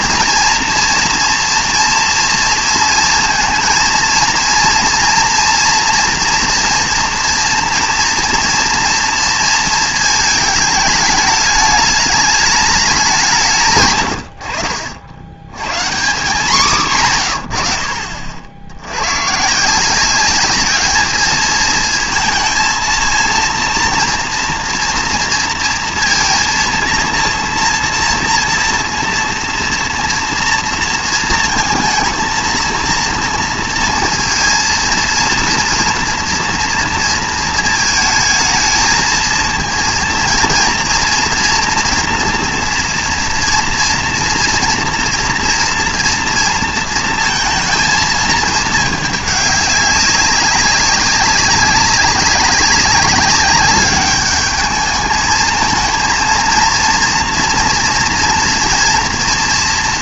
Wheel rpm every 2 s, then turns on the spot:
230, 230, 230, 230, 230, 210, 210, 70, 160, 80, 210, 230, 230, 230, 230, 230, 230, 230, 230, 220, 230, 230, 230, 230, 220, 190, 200, 210, 220, 240.
none